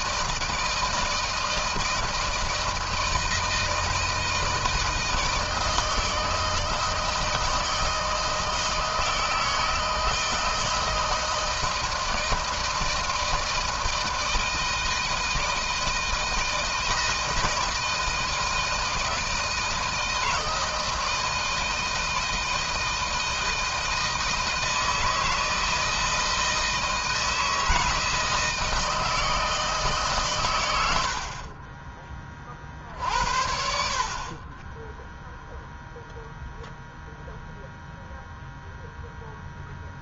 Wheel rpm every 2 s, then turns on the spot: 160, 160, 160, 160, 160, 160, 160, 160, 160, 160, 160, 160, 160, 160, 160, 100, 40, 20, 0, 0.
none